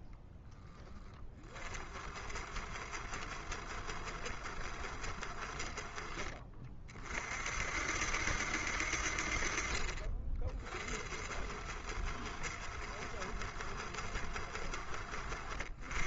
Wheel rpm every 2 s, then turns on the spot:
10, 60, 60, 40, 60, 40, 70, 60.
none